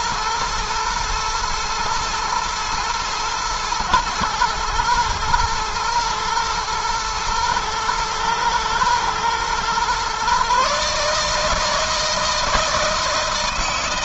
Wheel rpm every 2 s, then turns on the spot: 120, 110, 110, 110, 110, 140, 160.
none